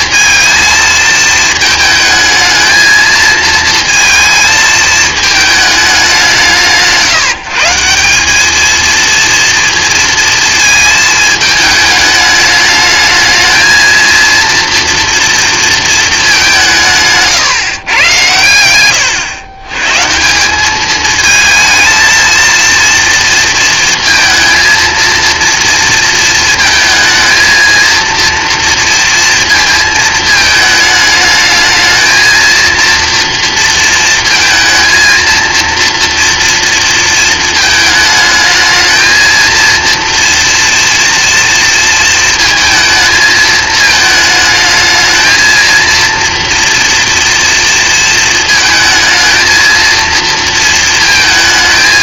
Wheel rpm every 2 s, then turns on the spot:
220, 220, 220, 160, 220, 220, 210, 230, 170, 110, 200, 230, 230, 220, 230, 220, 230, 230, 230, 220, 230, 220, 220, 230, 220, 220.
none